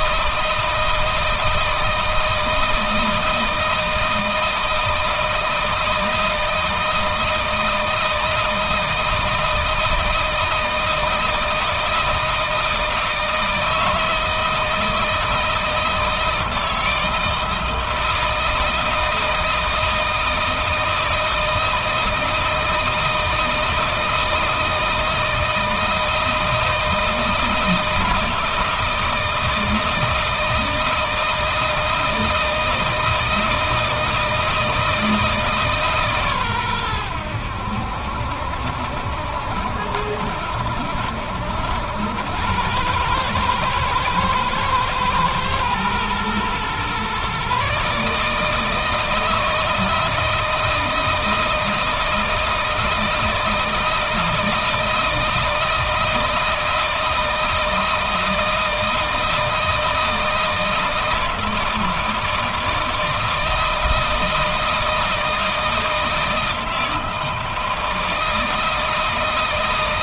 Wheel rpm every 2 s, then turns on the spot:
160, 160, 160, 160, 160, 160, 160, 160, 160, 160, 160, 160, 160, 160, 160, 160, 160, 160, 120, 70, 70, 90, 110, 120, 160, 160, 160, 160, 160, 160, 160, 160, 160, 160, 160.
none